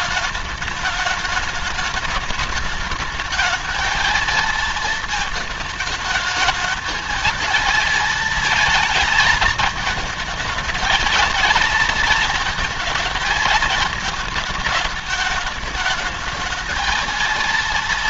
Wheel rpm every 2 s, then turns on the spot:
210, 220, 230, 220, 220, 220, 230, 210, 220.
none